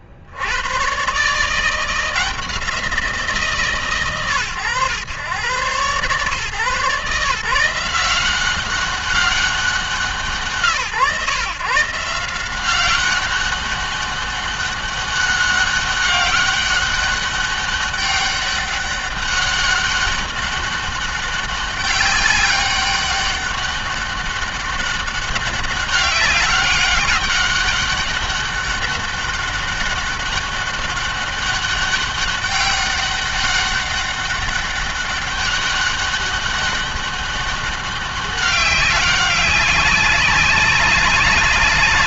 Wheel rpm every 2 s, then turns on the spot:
120, 170, 120, 140, 190, 140, 180, 200, 200, 200, 200, 190, 200, 200, 200, 200, 200, 200, 200, 200, 200.
none